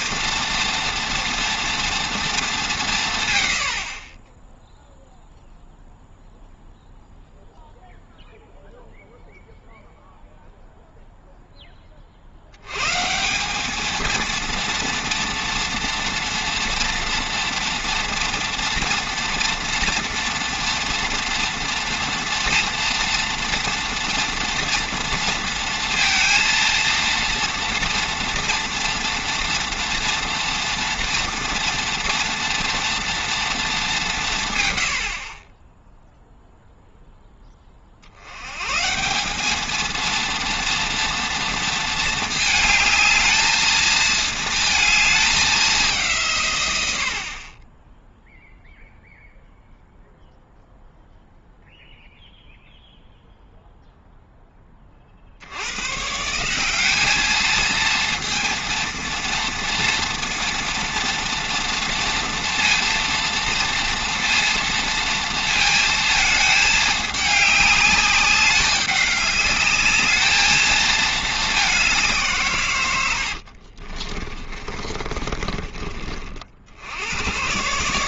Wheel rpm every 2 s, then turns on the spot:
230, 180, 0, 0, 0, 0, 100, 230, 230, 230, 230, 240, 230, 230, 230, 230, 240, 120, 0, 140, 230, 210, 220, 110, 0, 0, 0, 20, 190, 230, 230, 230, 230, 210, 200, 220, 120, 30, 70.
74-76